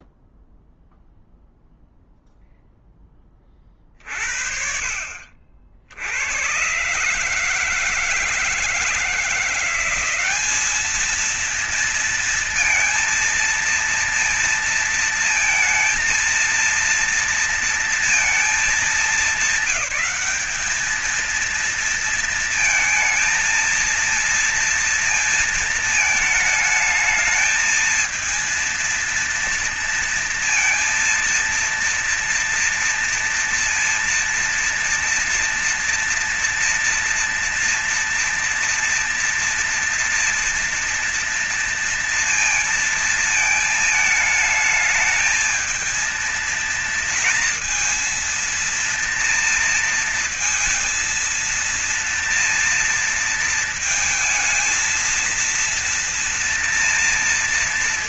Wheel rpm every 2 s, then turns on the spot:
0, 0, 50, 130, 160, 210, 230, 230, 230, 210, 210, 230, 230, 220, 230, 230, 230, 230, 230, 230, 230, 230, 220, 230, 230, 230, 230, 230, 230.
none